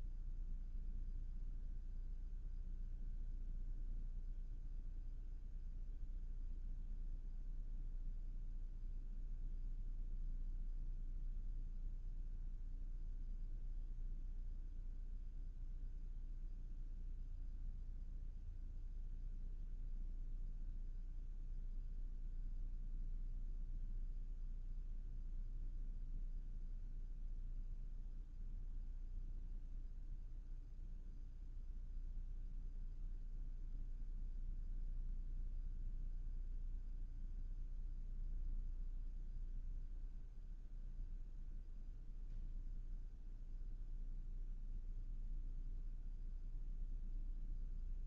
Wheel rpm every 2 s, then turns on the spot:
0, 0, 0, 0, 0, 0, 0, 0, 0, 0, 0, 0, 0, 0, 0, 0, 0, 0, 0, 0, 0, 0, 0, 0.
none